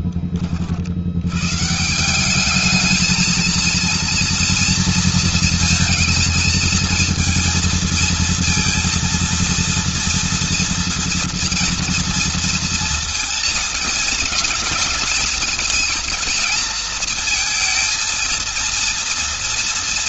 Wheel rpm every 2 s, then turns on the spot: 40, 200, 230, 220, 230, 240, 230, 230, 230, 230.
none